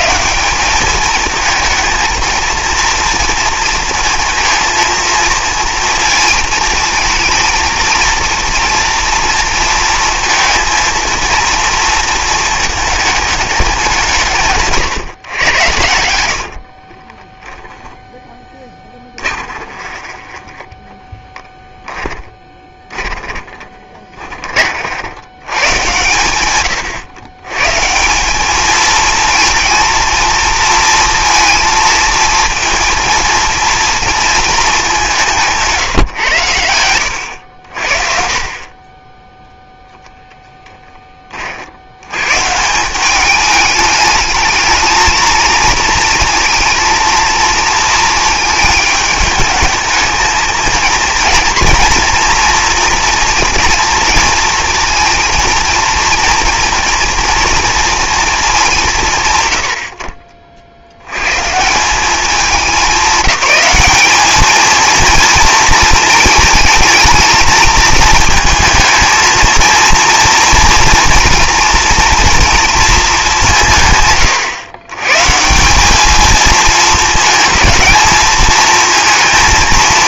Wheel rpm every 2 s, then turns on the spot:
210, 230, 220, 230, 230, 230, 220, 140, 30, 10, 20, 20, 40, 110, 220, 230, 230, 220, 90, 30, 10, 150, 220, 220, 220, 220, 230, 230, 230, 190, 60, 200, 220, 220, 230, 240, 230, 110, 220, 220.
16-18 20-24